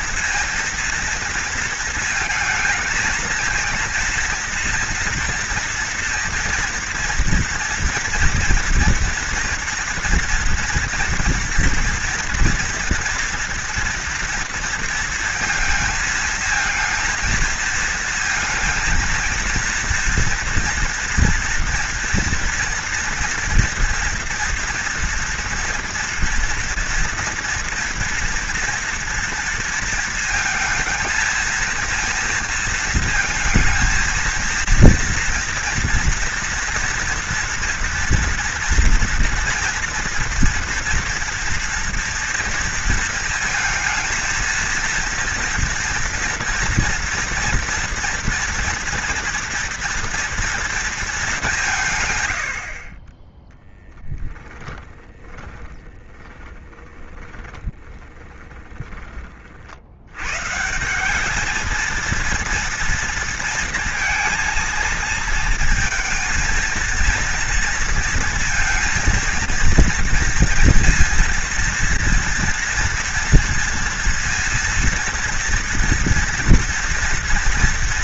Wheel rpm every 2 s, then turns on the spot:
240, 220, 230, 230, 230, 230, 230, 230, 230, 230, 230, 240, 230, 230, 230, 230, 230, 230, 230, 230, 230, 230, 230, 230, 230, 200, 20, 30, 20, 30, 200, 230, 230, 230, 230, 230, 230, 230, 230.
54-58